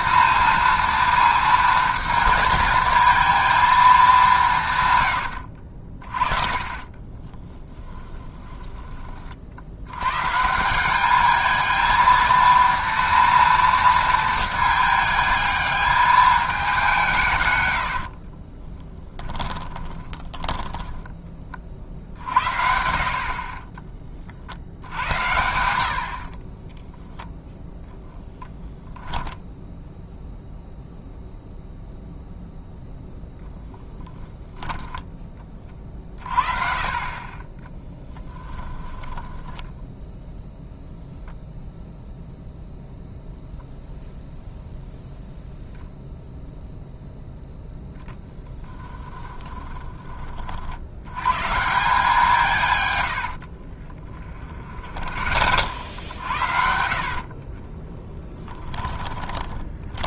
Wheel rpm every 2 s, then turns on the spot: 230, 220, 150, 30, 20, 180, 230, 220, 200, 30, 10, 60, 70, 20, 10, 0, 0, 10, 30, 10, 0, 0, 0, 0, 10, 60, 130, 50, 60, 10.
6-10 18-22 26-30 38-40 48-50 54-60